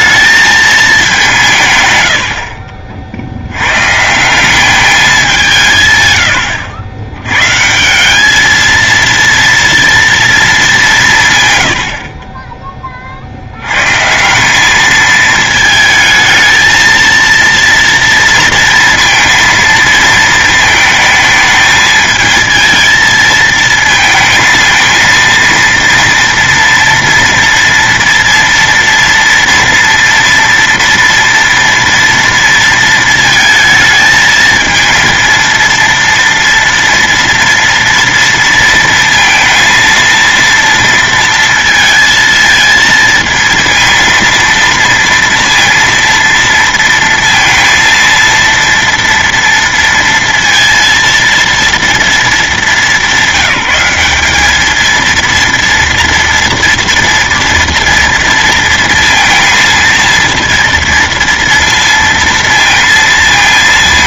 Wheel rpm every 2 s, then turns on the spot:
220, 50, 190, 90, 220, 210, 20, 210, 220, 230, 220, 220, 230, 230, 230, 230, 230, 220, 230, 230, 230, 230, 230, 230, 230, 230, 200, 210, 230, 230, 230, 230.
none